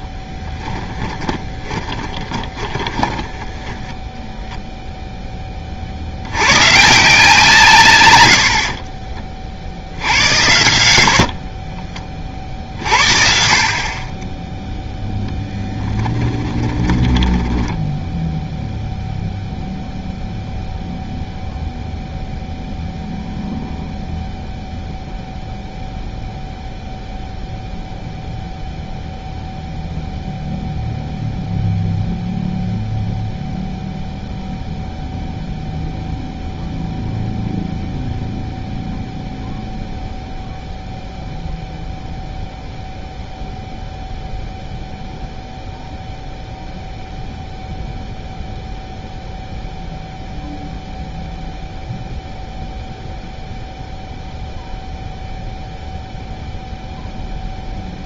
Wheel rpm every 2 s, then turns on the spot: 10, 10, 0, 120, 50, 70, 50, 0, 10, 0, 0, 0, 0, 0, 0, 0, 0, 0, 0, 0, 0, 0, 0, 0, 0, 0, 0, 0, 0.
0-4 8-10 16-18